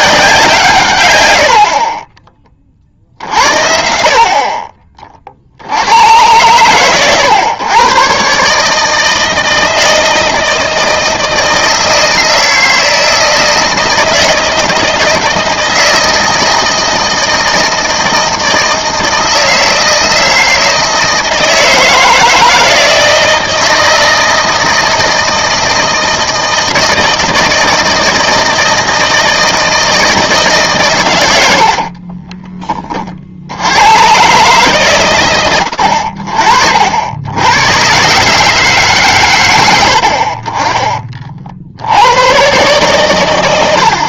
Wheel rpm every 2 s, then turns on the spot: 140, 40, 40, 120, 160, 160, 160, 160, 160, 160, 160, 160, 160, 160, 160, 130, 40, 130, 70, 130, 30, 110.
none